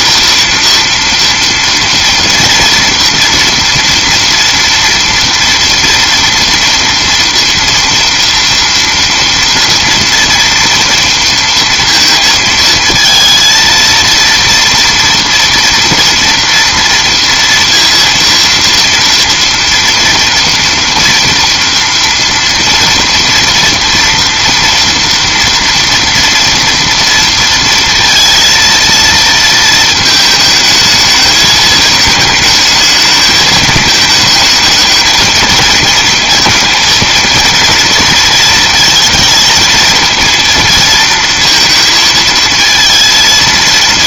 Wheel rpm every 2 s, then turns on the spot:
230, 230, 230, 230, 230, 230, 220, 230, 230, 230, 240, 230, 240, 230, 230, 220, 210, 220, 230, 230, 230, 220.
none